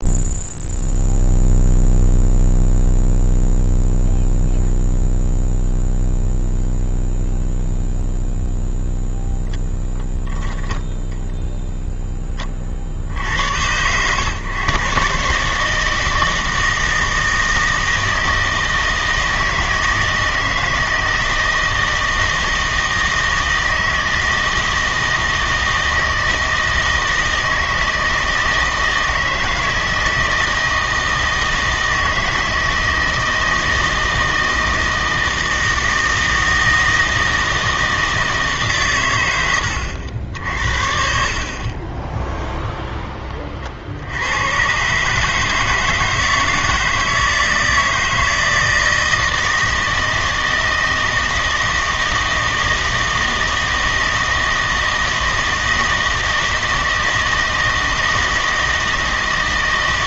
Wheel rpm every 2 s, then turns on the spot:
0, 0, 0, 0, 0, 10, 30, 120, 160, 160, 160, 160, 160, 160, 160, 160, 160, 160, 160, 150, 60, 0, 110, 160, 160, 160, 160, 160, 160, 160.
none